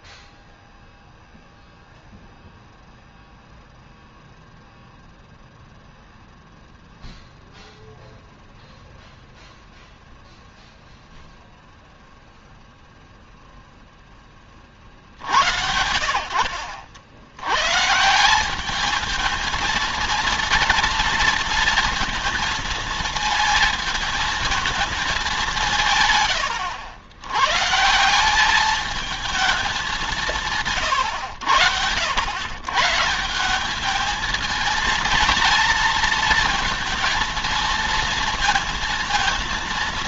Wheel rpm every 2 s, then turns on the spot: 0, 0, 0, 0, 0, 0, 0, 40, 70, 210, 230, 230, 220, 100, 210, 130, 130, 230, 230, 230.
none